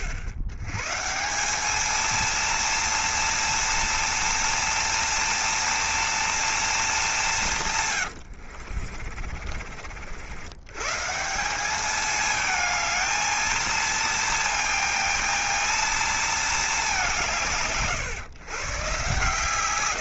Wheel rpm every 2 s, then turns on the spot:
140, 230, 230, 210, 50, 140, 220, 230, 190, 120.
8-10